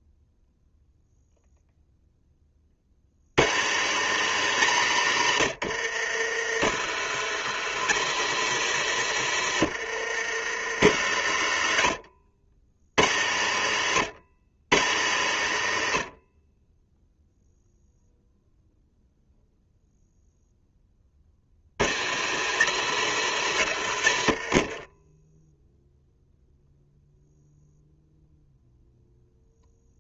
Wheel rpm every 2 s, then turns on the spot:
0, 50, 90, 80, 110, 50, 50, 70, 10, 0, 20, 110, 10, 0, 0.
none